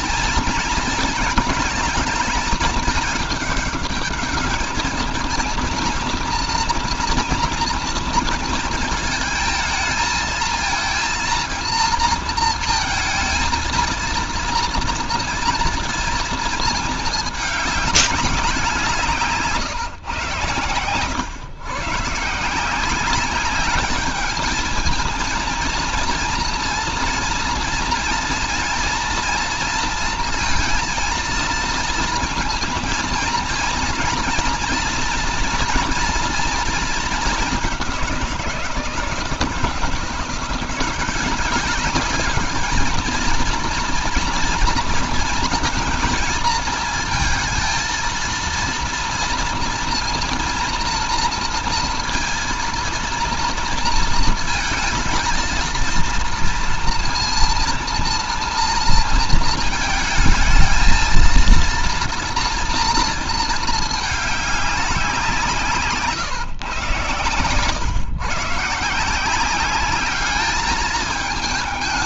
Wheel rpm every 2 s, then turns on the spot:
220, 220, 210, 230, 230, 220, 230, 230, 230, 190, 110, 160, 220, 230, 230, 230, 230, 230, 230, 180, 170, 210, 240, 230, 230, 230, 230, 220, 230, 230, 220, 230, 200, 130, 140, 210.
none